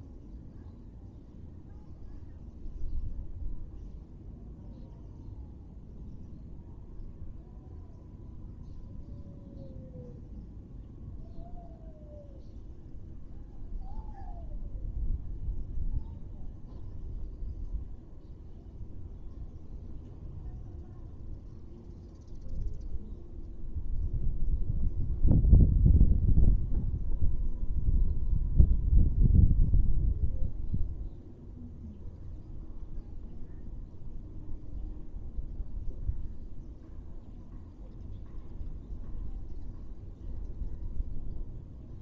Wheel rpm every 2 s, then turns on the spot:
0, 0, 0, 0, 0, 0, 0, 0, 0, 0, 0, 0, 0, 0, 0, 0, 0, 0, 0, 0, 0.
none